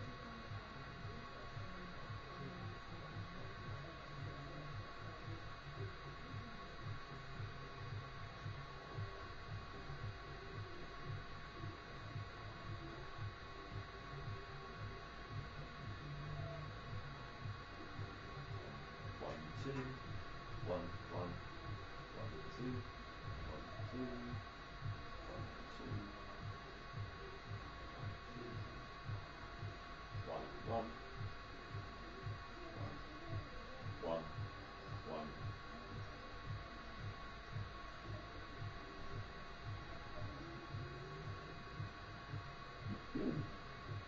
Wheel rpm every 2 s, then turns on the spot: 0, 0, 0, 0, 0, 0, 0, 0, 0, 0, 0, 0, 0, 0, 0, 0, 0, 0, 0, 0, 0, 0.
none